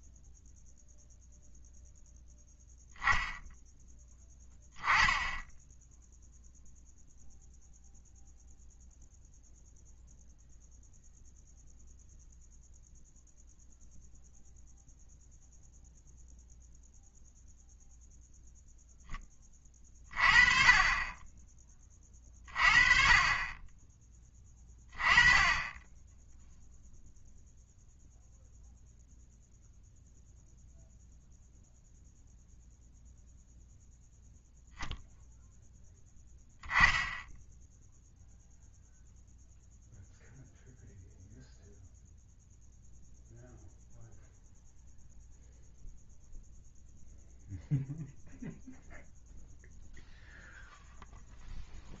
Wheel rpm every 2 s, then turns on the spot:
0, 0, 10, 0, 0, 0, 0, 0, 0, 0, 30, 40, 20, 0, 0, 0, 0, 0, 10, 0, 0, 0, 0, 0, 0, 0.
none